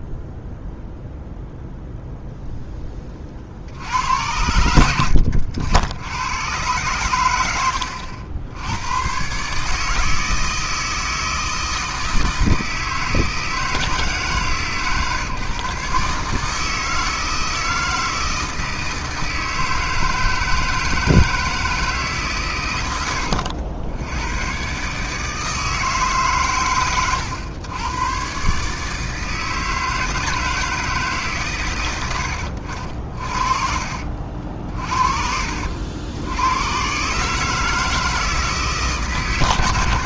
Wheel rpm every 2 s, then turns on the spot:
0, 10, 90, 110, 80, 160, 160, 150, 160, 160, 160, 120, 120, 120, 140, 160, 70, 50, 100, 150.
32-34